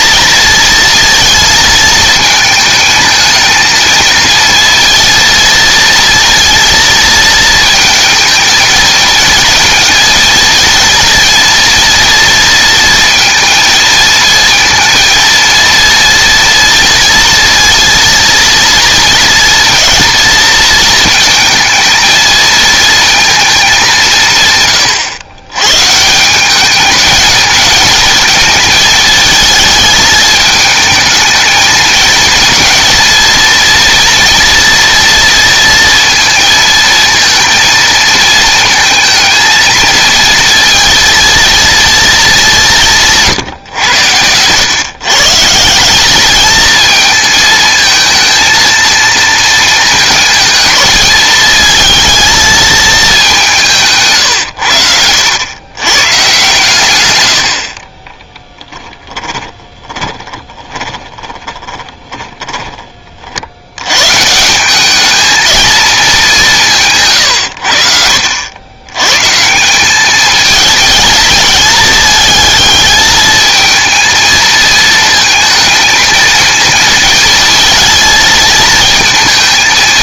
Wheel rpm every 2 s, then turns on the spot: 230, 220, 230, 230, 220, 230, 230, 230, 230, 230, 230, 230, 120, 200, 220, 220, 230, 230, 230, 220, 230, 180, 120, 220, 230, 220, 220, 90, 130, 10, 20, 20, 190, 170, 90, 220, 220, 220, 230, 230.
58-62